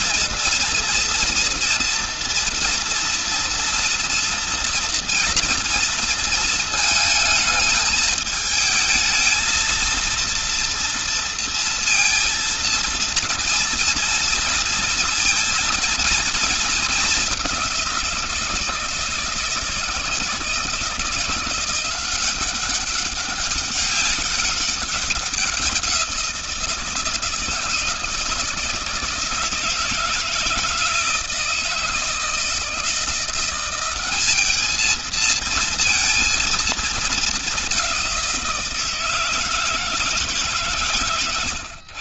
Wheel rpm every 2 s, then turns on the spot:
230, 230, 240, 220, 230, 230, 230, 230, 190, 160, 170, 200, 190, 160, 160, 160, 170, 220, 220, 170, 120.
none